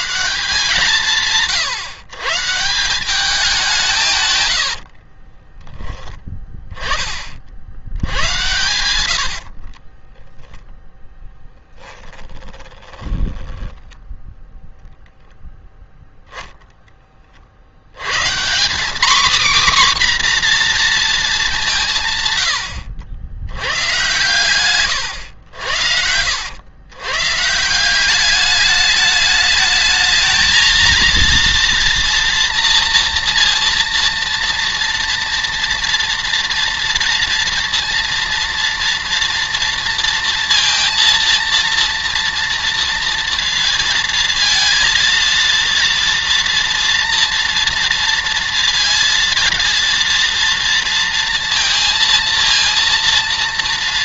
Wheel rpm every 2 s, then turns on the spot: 160, 160, 90, 20, 90, 0, 20, 0, 10, 210, 250, 100, 110, 100, 200, 230, 230, 230, 230, 230, 230, 230, 220, 240, 230, 230, 230.
4-6 8-10 12-14